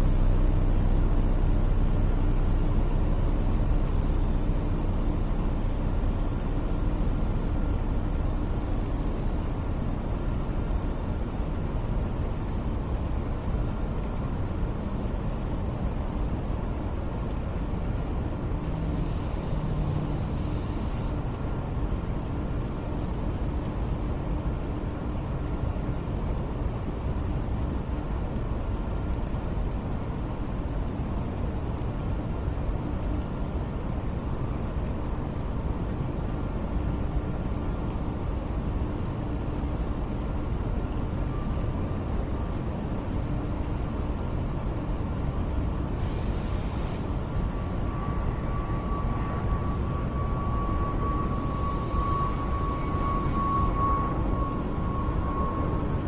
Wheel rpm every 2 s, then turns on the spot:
0, 0, 0, 0, 0, 0, 0, 0, 0, 0, 0, 0, 0, 0, 0, 0, 0, 0, 0, 0, 0, 0, 0, 0, 0, 0, 0, 0.
none